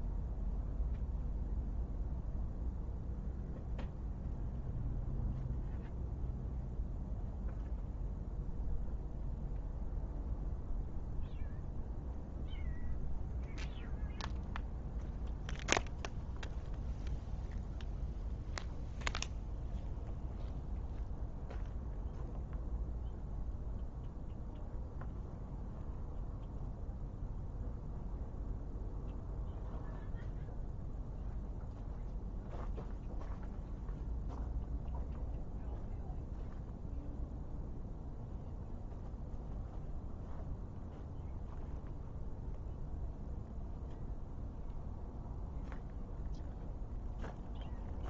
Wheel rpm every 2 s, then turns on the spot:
0, 0, 0, 0, 0, 0, 0, 0, 0, 0, 0, 0, 0, 0, 0, 0, 0, 0, 0, 0, 0, 0, 0, 0.
none